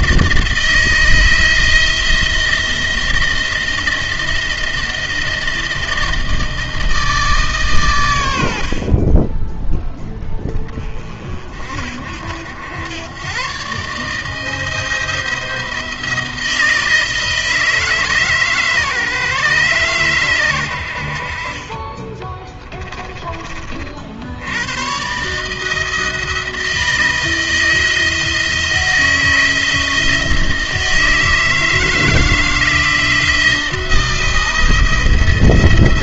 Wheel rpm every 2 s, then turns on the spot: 160, 160, 160, 160, 60, 40, 90, 160, 170, 150, 100, 20, 90, 160, 160, 160, 160, 170.
22-24